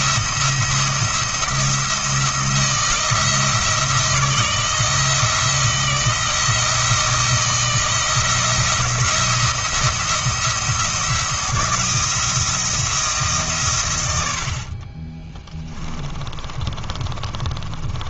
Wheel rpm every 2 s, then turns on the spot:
170, 170, 160, 160, 170, 170, 170, 50, 40.
16-18